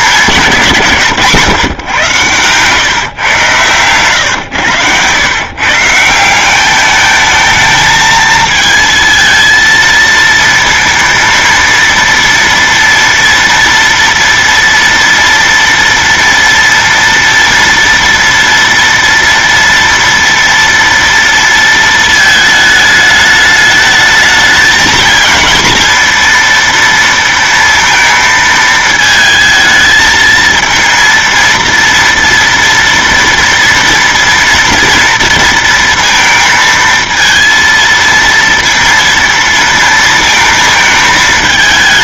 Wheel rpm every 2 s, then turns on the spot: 200, 120, 110, 170, 220, 230, 230, 230, 230, 230, 230, 220, 220, 230, 230, 220, 230, 230, 230, 230, 230.
none